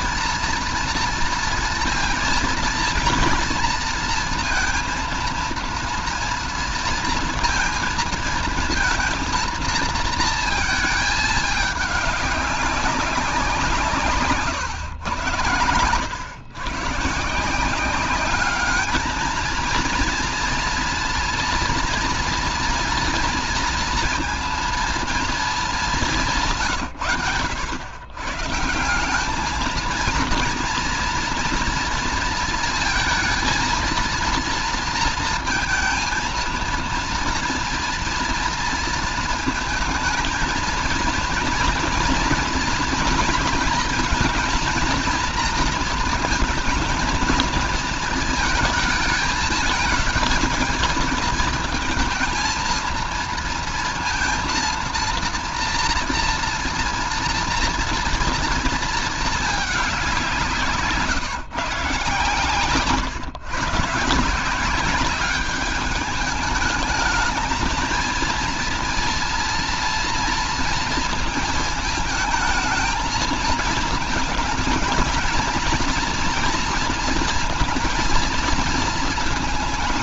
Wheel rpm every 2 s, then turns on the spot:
230, 230, 230, 230, 230, 230, 200, 130, 120, 200, 230, 230, 230, 160, 140, 230, 230, 230, 230, 230, 220, 240, 230, 220, 220, 220, 230, 230, 230, 230, 180, 130, 170, 210, 230, 230, 220, 220, 230, 230.
26-28